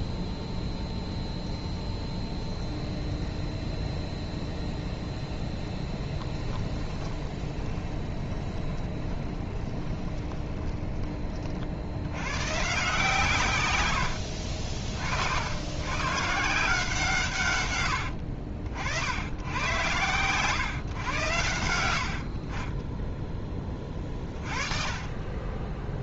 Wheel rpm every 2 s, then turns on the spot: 0, 0, 0, 20, 20, 20, 140, 60, 160, 70, 130, 20, 30.
6-12 22-24